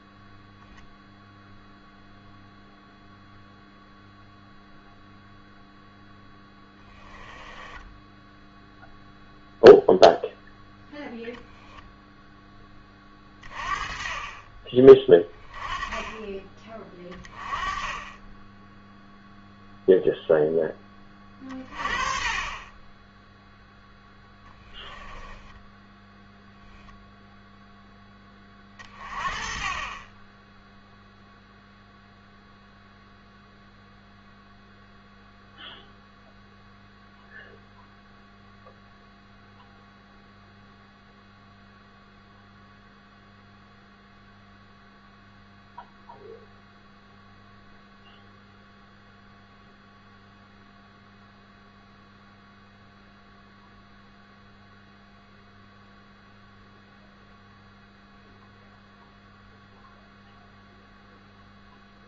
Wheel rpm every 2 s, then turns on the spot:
0, 0, 0, 10, 0, 0, 20, 30, 20, 0, 10, 10, 10, 0, 40, 0, 0, 0, 0, 0, 0, 0, 0, 0, 0, 0, 0, 0, 0, 0, 0.
6-8 24-26